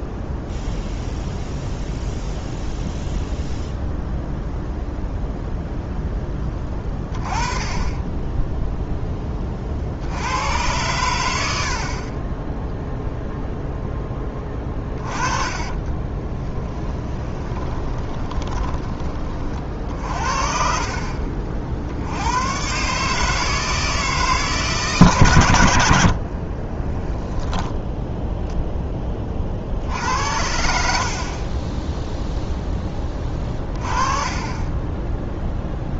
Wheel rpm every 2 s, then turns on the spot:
0, 0, 0, 20, 0, 100, 0, 20, 20, 20, 50, 140, 150, 30, 10, 60, 10, 10.
14-20 26-28